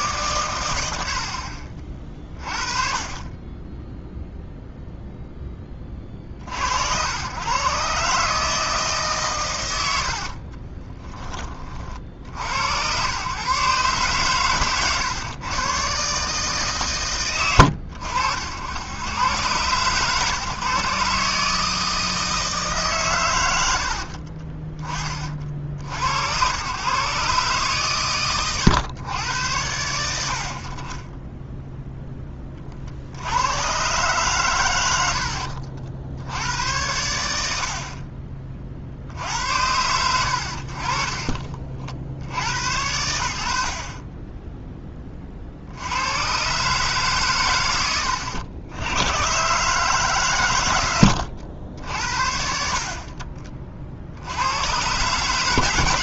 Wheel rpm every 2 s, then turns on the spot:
80, 30, 0, 70, 150, 30, 90, 120, 140, 80, 140, 150, 30, 110, 120, 50, 40, 110, 100, 40, 50, 80, 10, 130, 90, 120, 60, 110.
10-12